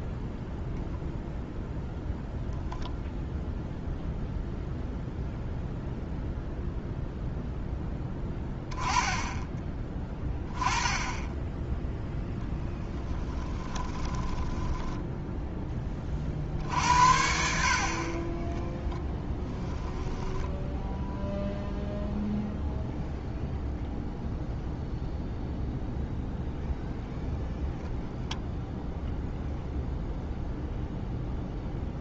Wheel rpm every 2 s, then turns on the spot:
0, 0, 0, 0, 10, 20, 10, 10, 60, 10, 10, 0, 0, 0, 0, 0.
12-16 18-22